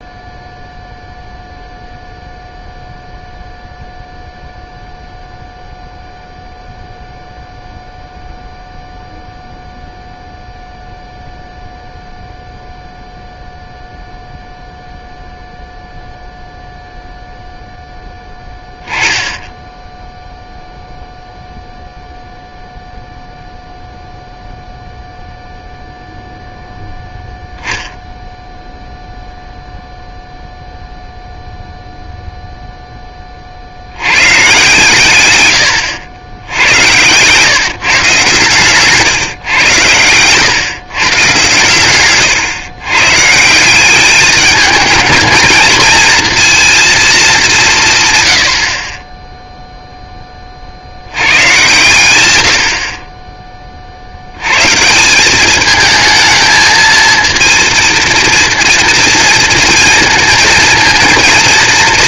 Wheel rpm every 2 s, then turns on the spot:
0, 0, 0, 0, 0, 0, 0, 0, 0, 10, 0, 0, 0, 0, 0, 0, 0, 130, 100, 120, 110, 130, 210, 230, 100, 20, 100, 100, 220, 230, 220.
none